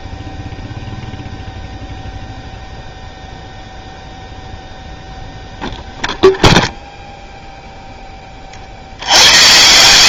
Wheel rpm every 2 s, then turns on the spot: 0, 0, 0, 0, 70.
none